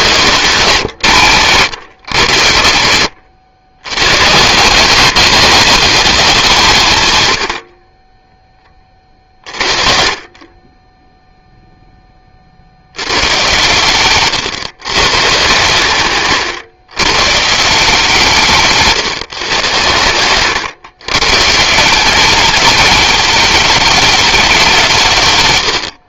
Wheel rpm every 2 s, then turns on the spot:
140, 80, 150, 180, 20, 30, 60, 130, 130, 160, 110, 210, 200.
0-4